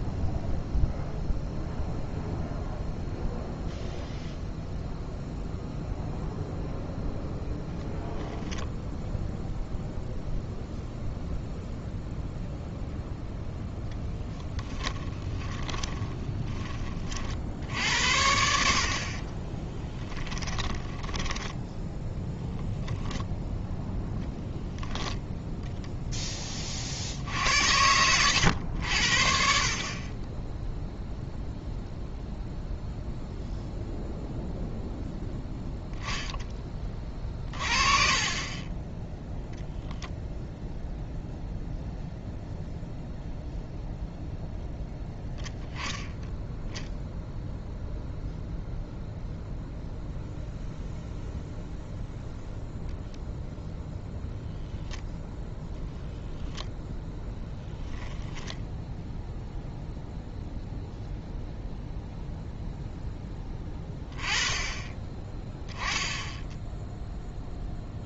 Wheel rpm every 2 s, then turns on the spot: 0, 0, 0, 0, 0, 0, 0, 10, 30, 50, 10, 0, 0, 40, 80, 0, 0, 0, 20, 10, 0, 0, 0, 0, 0, 0, 0, 0, 10, 0, 0, 0, 20, 0.
14-16